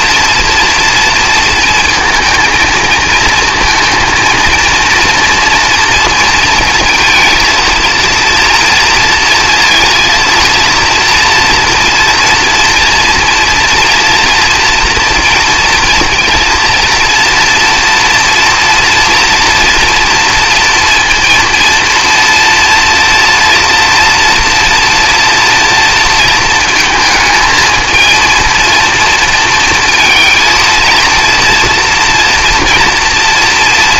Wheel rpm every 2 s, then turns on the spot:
240, 230, 230, 230, 230, 230, 230, 230, 230, 240, 230, 230, 230, 230, 230, 230, 240.
none